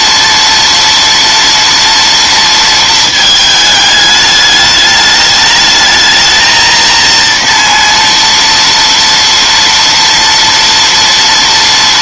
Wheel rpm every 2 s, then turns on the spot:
230, 230, 210, 220, 230, 230.
none